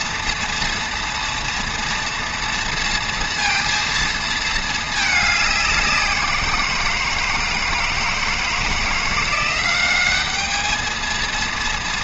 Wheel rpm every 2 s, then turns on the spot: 230, 230, 210, 160, 170, 220.
none